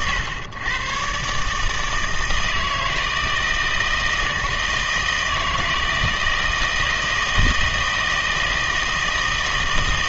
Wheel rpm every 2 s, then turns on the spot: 110, 160, 160, 160, 160.
none